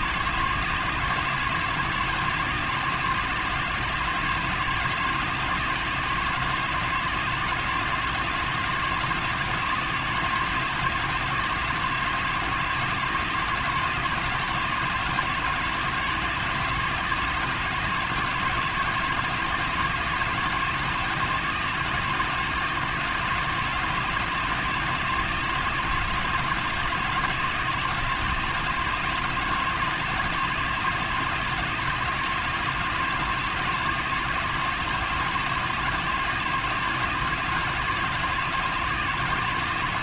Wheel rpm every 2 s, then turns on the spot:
170, 170, 160, 160, 170, 170, 170, 170, 170, 170, 160, 160, 160, 160, 170, 160, 160, 160, 170, 170.
none